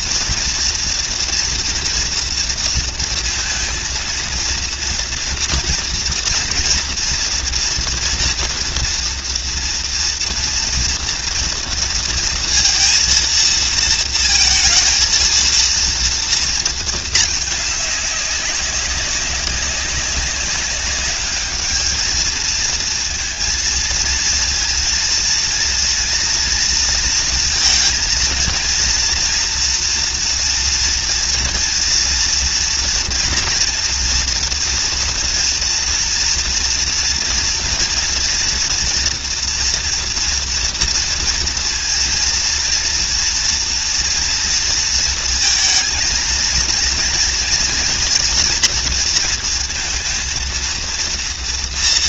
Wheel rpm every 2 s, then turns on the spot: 230, 230, 230, 230, 230, 230, 230, 230, 230, 200, 200, 220, 230, 230, 230, 240, 240, 230, 240, 230, 240, 230, 230, 230, 240, 230.
none